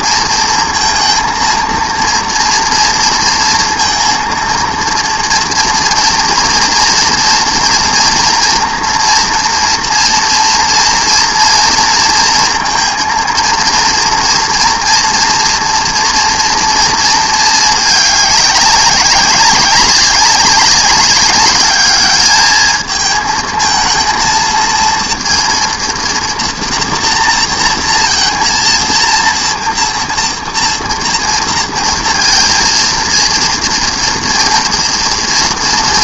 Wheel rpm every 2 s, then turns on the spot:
230, 230, 230, 230, 240, 240, 230, 230, 230, 200, 200, 220, 230, 230, 230, 230, 230, 230.
none